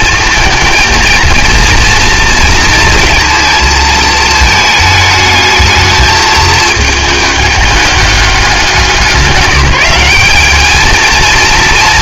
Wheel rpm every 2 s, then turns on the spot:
230, 230, 220, 220, 200, 210.
none